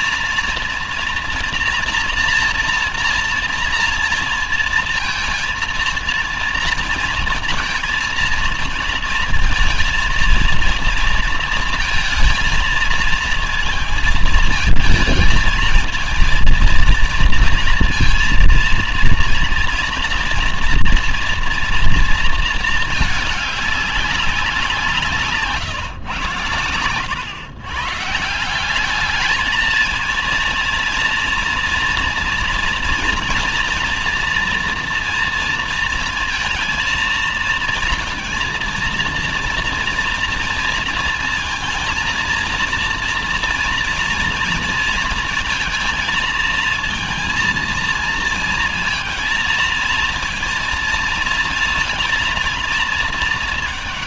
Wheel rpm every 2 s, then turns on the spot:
230, 230, 230, 230, 230, 230, 230, 220, 230, 230, 230, 220, 150, 100, 200, 230, 230, 230, 230, 230, 230, 230, 230, 230, 230, 230, 220.
none